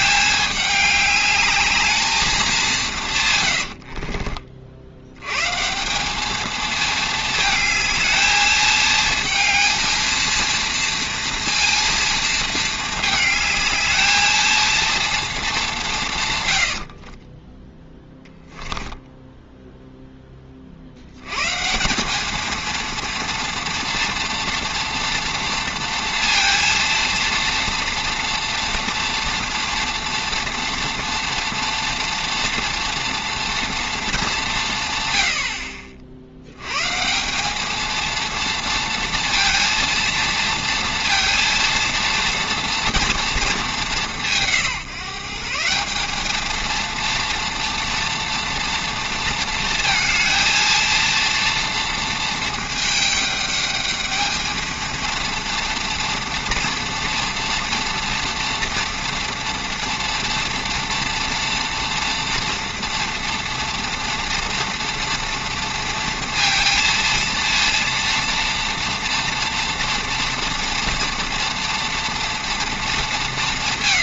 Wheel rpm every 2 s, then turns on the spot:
210, 180, 60, 220, 220, 230, 220, 220, 90, 10, 40, 220, 230, 230, 230, 230, 230, 140, 110, 230, 230, 240, 160, 230, 230, 230, 220, 220, 230, 230, 230, 230, 230, 230, 230, 230, 220.
16-20